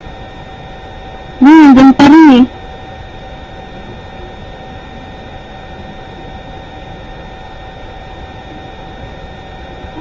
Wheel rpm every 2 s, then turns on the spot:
0, 0, 0, 0, 0.
none